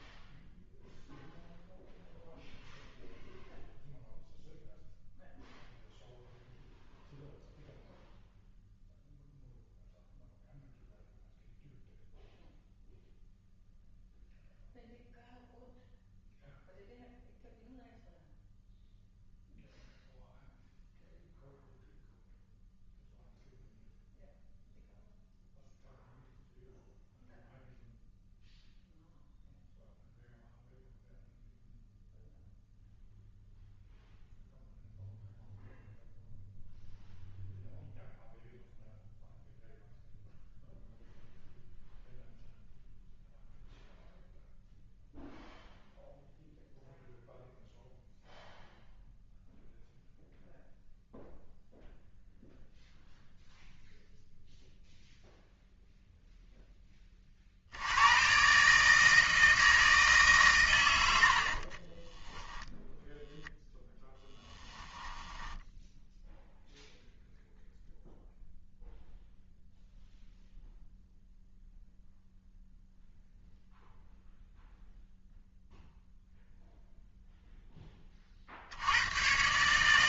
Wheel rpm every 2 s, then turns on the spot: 0, 0, 0, 0, 0, 0, 0, 0, 0, 0, 0, 0, 0, 0, 0, 0, 0, 0, 0, 0, 0, 0, 0, 0, 0, 0, 0, 0, 10, 140, 130, 0, 10, 0, 0, 0, 0, 0, 0, 70.
64-66